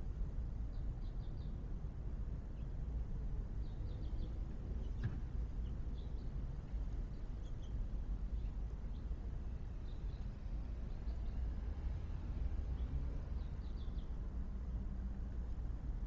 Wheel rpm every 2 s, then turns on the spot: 0, 0, 0, 0, 0, 0, 0, 0.
none